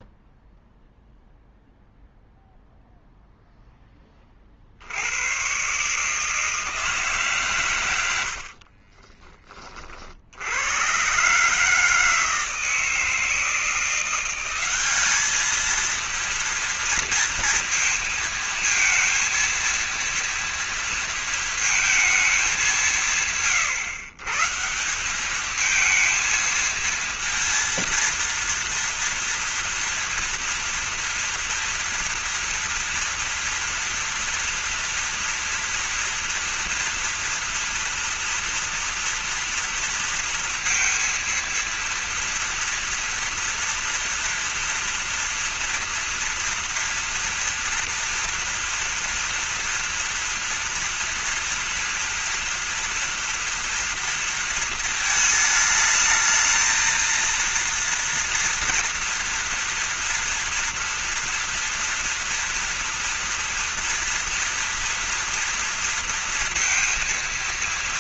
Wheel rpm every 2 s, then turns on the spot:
0, 0, 60, 160, 60, 90, 160, 180, 230, 220, 240, 190, 160, 230, 230, 230, 230, 230, 230, 240, 230, 230, 230, 230, 230, 230, 230, 230, 220, 230, 230, 230, 230, 230.
none